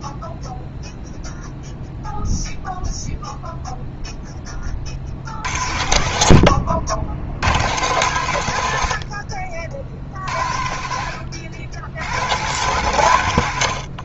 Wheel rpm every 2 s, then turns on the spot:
0, 0, 20, 80, 100, 70, 130.
none